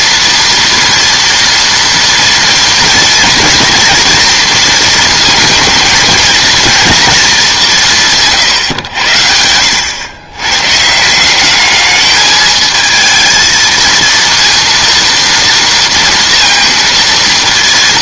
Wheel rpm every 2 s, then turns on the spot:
230, 230, 230, 230, 140, 130, 220, 230, 230.
none